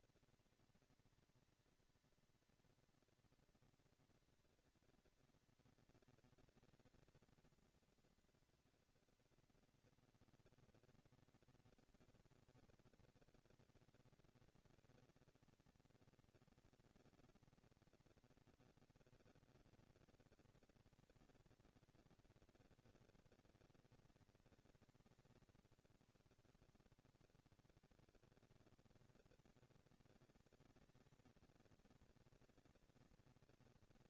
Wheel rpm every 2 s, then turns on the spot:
230, 230, 230, 230, 230, 230, 240, 230, 230, 230, 230, 230, 190, 100, 200, 220, 230.
none